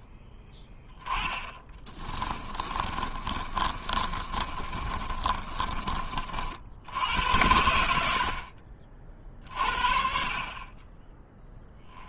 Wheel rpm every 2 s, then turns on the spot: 20, 30, 30, 50, 50, 40.
2-6